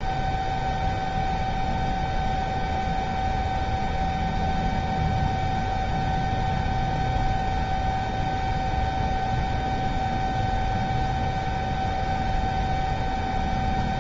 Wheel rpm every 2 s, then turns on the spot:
0, 0, 0, 0, 0, 0, 0.
none